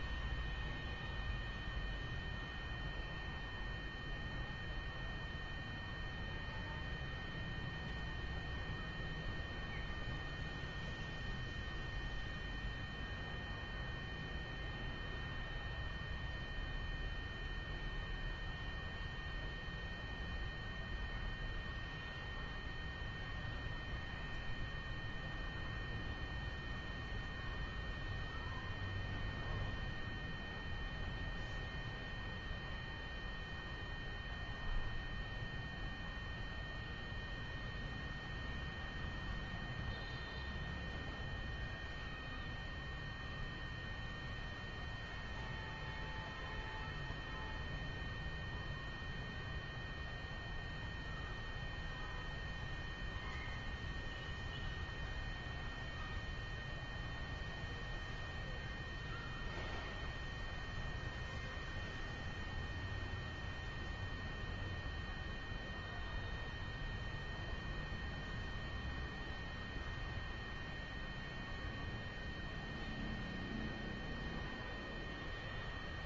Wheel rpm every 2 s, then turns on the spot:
0, 0, 0, 0, 0, 0, 0, 0, 0, 0, 0, 0, 0, 0, 0, 0, 0, 0, 0, 0, 0, 0, 0, 0, 0, 0, 0, 0, 0, 0, 0, 0, 0, 0, 0, 0, 0, 0.
none